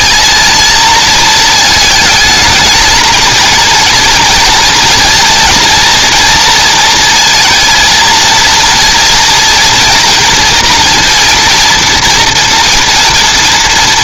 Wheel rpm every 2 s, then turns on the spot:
230, 220, 240, 230, 230, 230, 230.
none